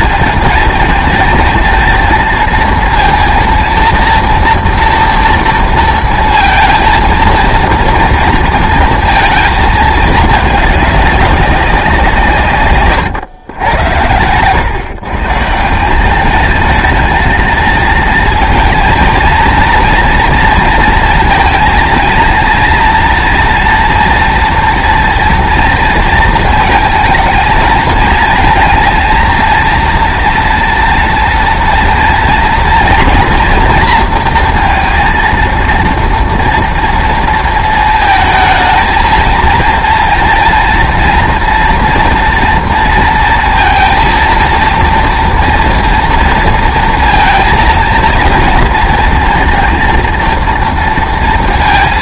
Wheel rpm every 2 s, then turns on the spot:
220, 230, 230, 230, 230, 210, 130, 120, 220, 220, 230, 230, 230, 220, 230, 230, 230, 230, 230, 220, 230, 230, 230, 230, 230, 230.
12-14